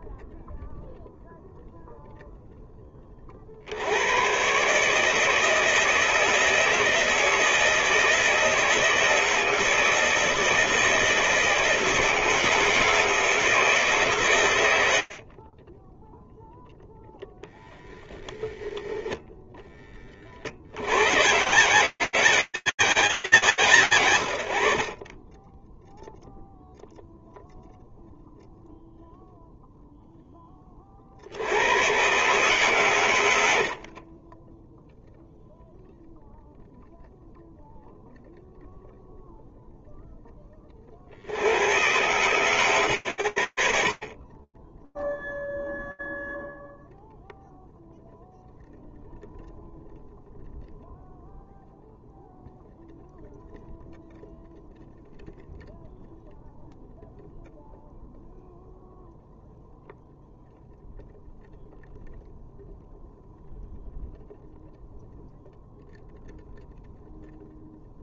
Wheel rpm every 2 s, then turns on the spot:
0, 0, 120, 160, 160, 160, 160, 150, 0, 0, 90, 180, 80, 0, 0, 60, 100, 0, 0, 0, 120, 50, 0, 0, 0, 0, 0, 0, 0, 0, 0, 0, 0, 0.
32-34